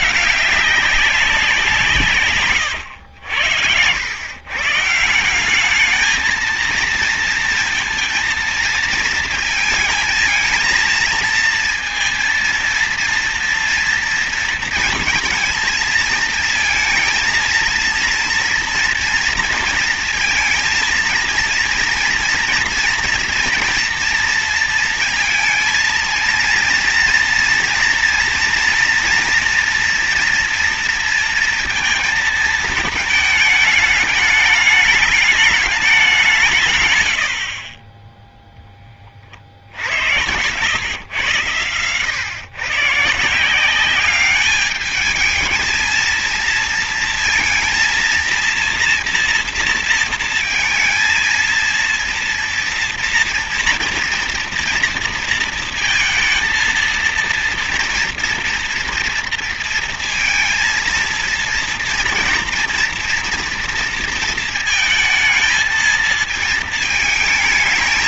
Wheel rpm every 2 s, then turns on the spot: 200, 120, 140, 230, 230, 230, 230, 230, 220, 230, 230, 230, 230, 230, 240, 230, 220, 210, 120, 10, 110, 130, 210, 230, 240, 230, 230, 230, 230, 230, 230, 230, 220, 220.
none